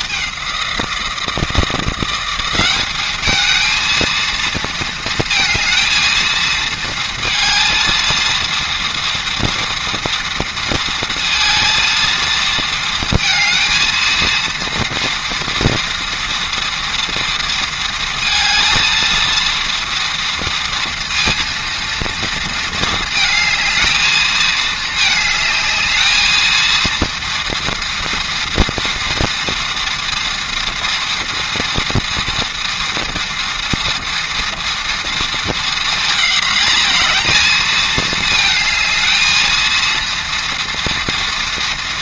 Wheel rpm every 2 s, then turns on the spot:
190, 190, 230, 230, 230, 230, 230, 230, 230, 230, 230, 230, 220, 220, 230, 240, 230, 230, 230, 220, 230.
none